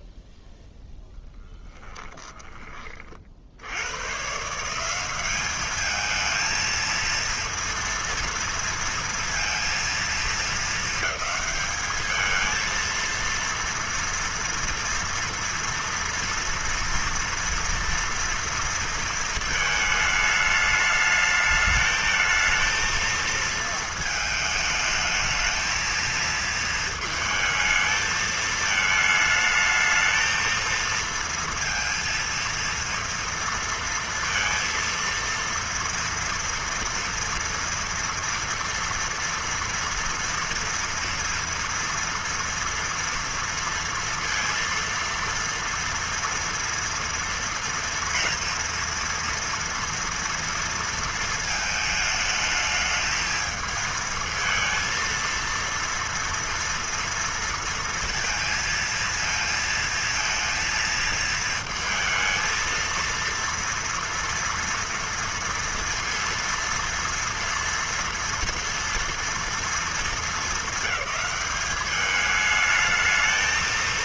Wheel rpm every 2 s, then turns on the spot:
0, 10, 130, 220, 230, 230, 220, 230, 230, 230, 210, 220, 220, 230, 220, 220, 230, 230, 230, 230, 230, 230, 230, 230, 230, 230, 210, 220, 230, 230, 230, 230, 230, 230, 230, 220, 210.
none